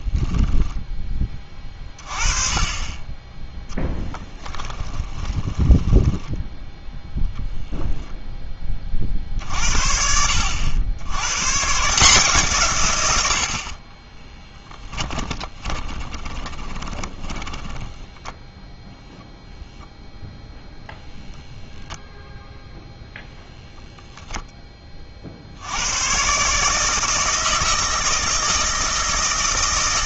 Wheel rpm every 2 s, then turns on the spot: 10, 30, 20, 10, 20, 80, 130, 10, 20, 0, 0, 0, 20, 150, 160.
4-6 14-18